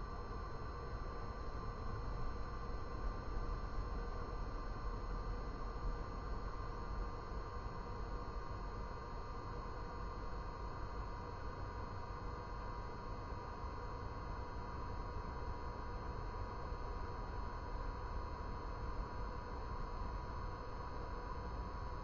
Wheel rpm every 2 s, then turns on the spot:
0, 0, 0, 0, 0, 0, 0, 0, 0, 0, 0.
none